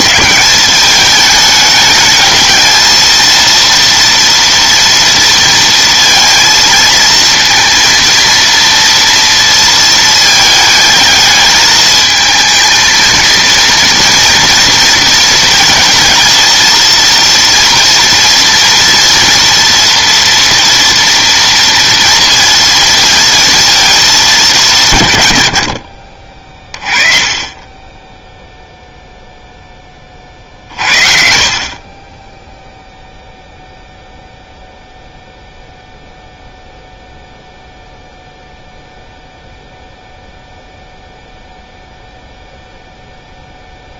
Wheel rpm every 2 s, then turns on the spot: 200, 220, 230, 230, 230, 220, 220, 230, 230, 230, 230, 230, 170, 30, 0, 50, 0, 0, 0, 0, 0, 0.
none